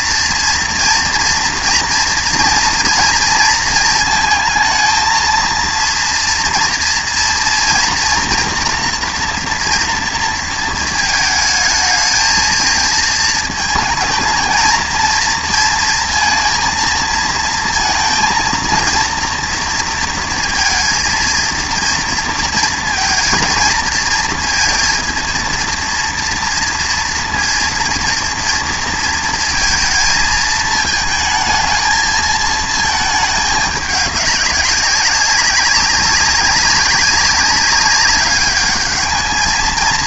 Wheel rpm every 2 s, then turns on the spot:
230, 230, 220, 230, 240, 220, 220, 220, 230, 230, 230, 230, 230, 230, 230, 220, 220, 190, 190, 200.
none